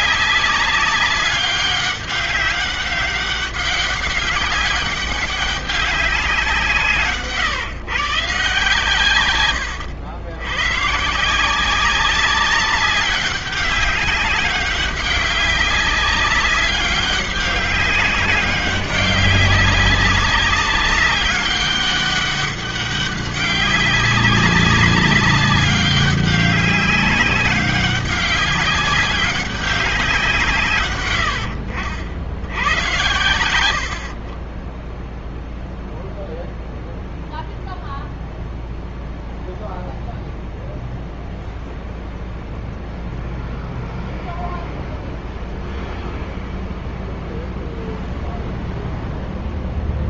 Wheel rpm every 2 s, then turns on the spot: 200, 200, 190, 160, 140, 110, 190, 190, 200, 200, 200, 200, 190, 200, 190, 150, 90, 30, 0, 0, 0, 0, 0, 0, 0.
30-32